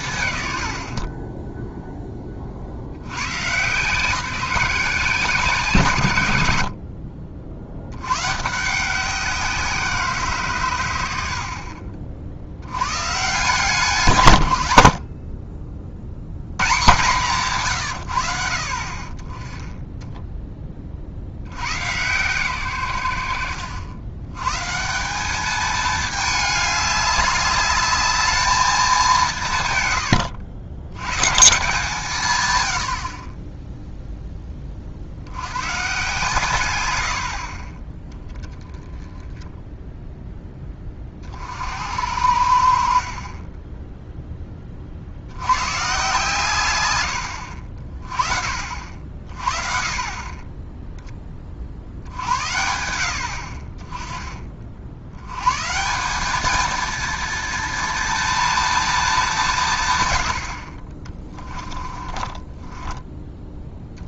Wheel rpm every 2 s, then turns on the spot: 90, 60, 170, 90, 160, 150, 40, 120, 140, 60, 40, 120, 130, 210, 210, 100, 110, 20, 110, 10, 10, 70, 30, 120, 60, 10, 70, 40, 220, 230, 50, 20.
62-64